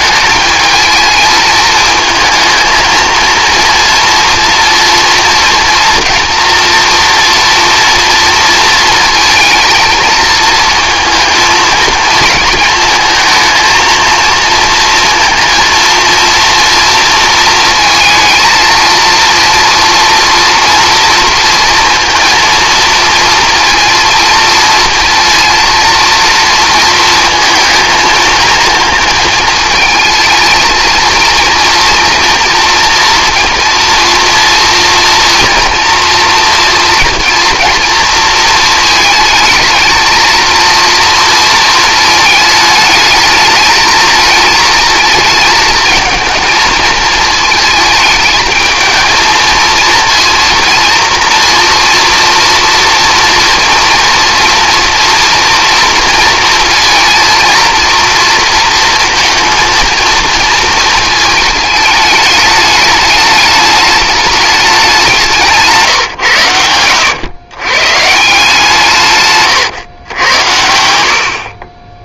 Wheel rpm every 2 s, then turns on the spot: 220, 230, 230, 240, 230, 230, 220, 230, 230, 230, 230, 230, 230, 230, 220, 220, 240, 230, 230, 220, 230, 220, 230, 220, 220, 230, 230, 240, 230, 230, 230, 210, 210, 110, 160, 80.
70-72